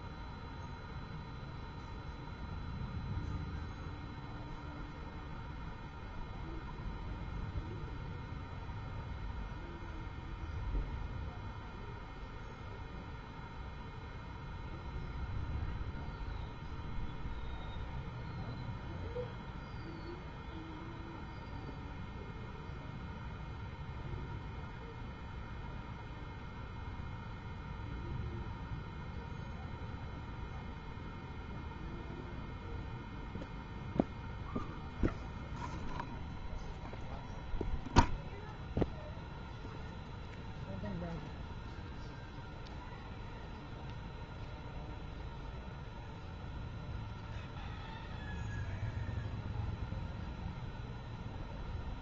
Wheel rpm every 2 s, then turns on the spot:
0, 0, 0, 0, 0, 0, 0, 0, 0, 0, 0, 0, 0, 0, 0, 0, 0, 0, 0, 0, 0, 0, 0, 0, 0, 0.
none